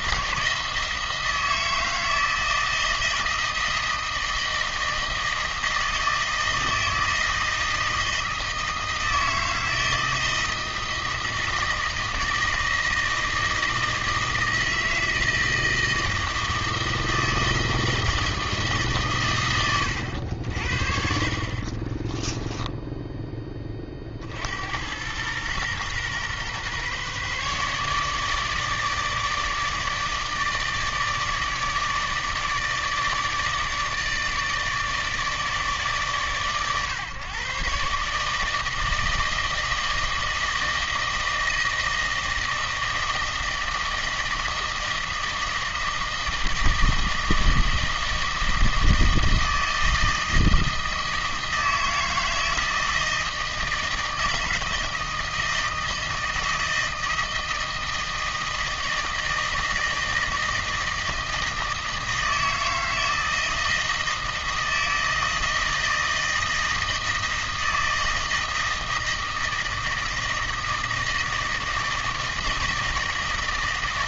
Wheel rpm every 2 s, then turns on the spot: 160, 160, 160, 160, 160, 160, 160, 160, 160, 150, 60, 20, 90, 130, 150, 150, 150, 150, 130, 160, 160, 160, 160, 160, 160, 160, 160, 160, 160, 160, 160, 160, 160, 160, 160, 160, 160.
22-24